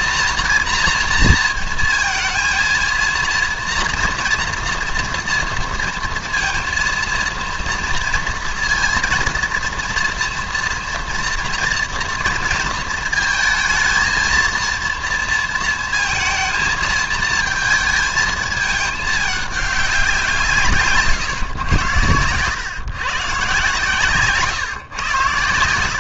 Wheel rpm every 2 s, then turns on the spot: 230, 230, 230, 230, 230, 230, 220, 230, 230, 220, 160, 120, 140.
none